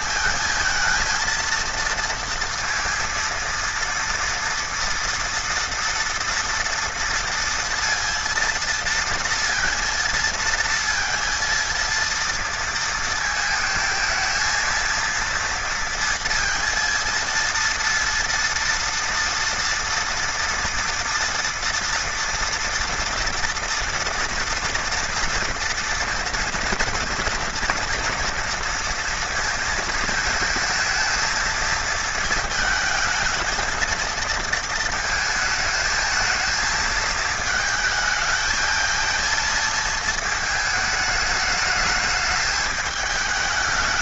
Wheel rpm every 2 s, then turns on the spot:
230, 230, 230, 230, 230, 230, 230, 230, 230, 230, 230, 240, 230, 230, 230, 230, 220, 230, 220, 220, 220, 210.
none